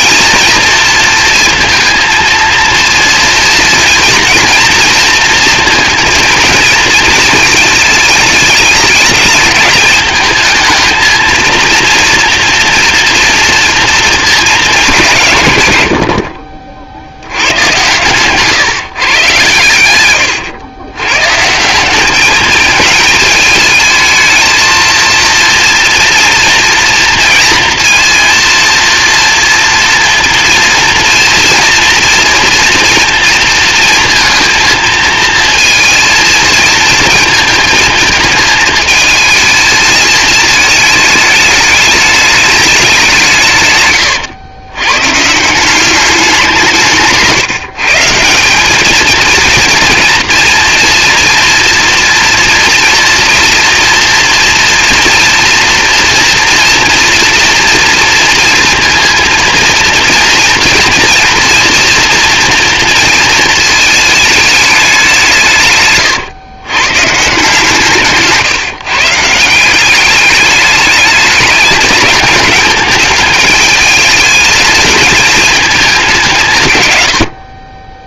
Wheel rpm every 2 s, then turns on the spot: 230, 230, 230, 230, 210, 220, 230, 200, 60, 140, 110, 210, 220, 240, 230, 230, 230, 230, 230, 220, 220, 200, 120, 160, 210, 230, 230, 230, 230, 230, 230, 230, 200, 130, 160, 210, 210, 220, 110.
none